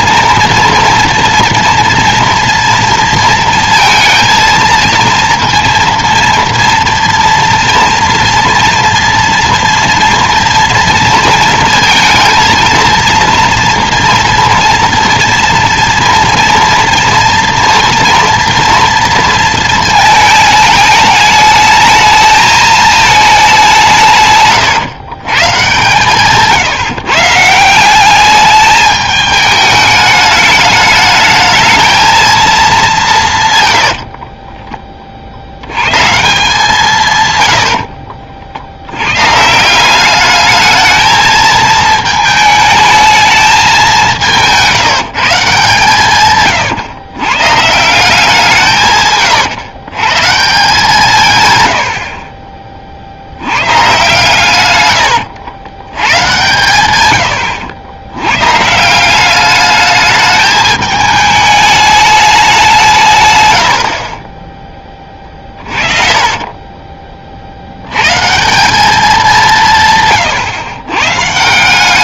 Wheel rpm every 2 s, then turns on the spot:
230, 230, 230, 230, 230, 230, 230, 230, 230, 230, 210, 220, 120, 150, 210, 210, 210, 20, 160, 70, 220, 220, 170, 130, 160, 160, 40, 110, 110, 140, 210, 190, 20, 20, 180, 120.
none